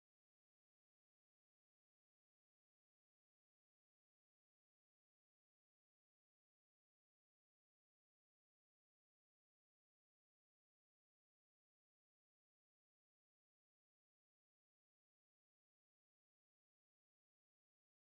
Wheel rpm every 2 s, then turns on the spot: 0, 0, 0, 0, 0, 0, 0, 0, 0.
none